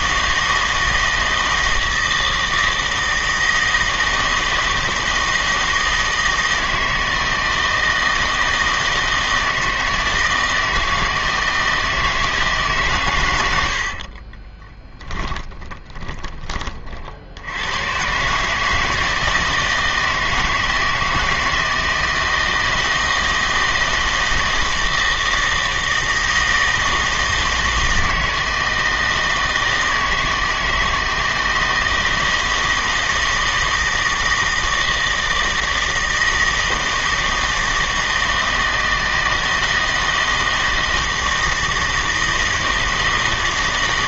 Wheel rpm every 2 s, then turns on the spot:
160, 160, 160, 160, 160, 160, 150, 20, 30, 160, 160, 160, 160, 160, 160, 160, 160, 160, 160, 160, 160, 160.
14-16